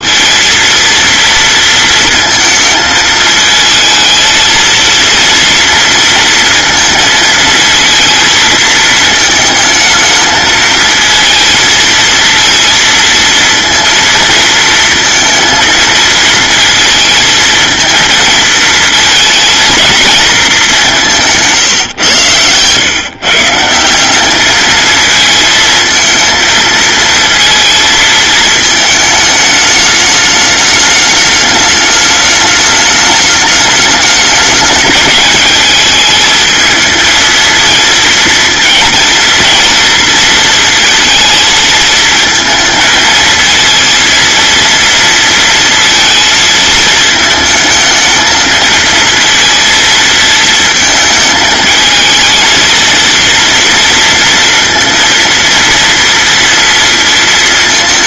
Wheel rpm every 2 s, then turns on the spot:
230, 220, 230, 230, 220, 220, 230, 230, 230, 220, 180, 130, 220, 220, 220, 210, 210, 210, 220, 230, 230, 220, 230, 220, 230, 220, 230, 230, 230.
none